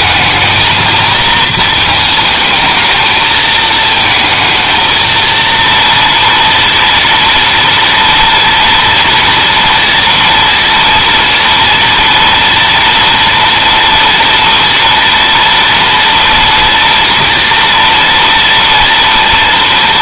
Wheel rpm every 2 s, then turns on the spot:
220, 220, 220, 230, 230, 230, 230, 230, 240, 230.
none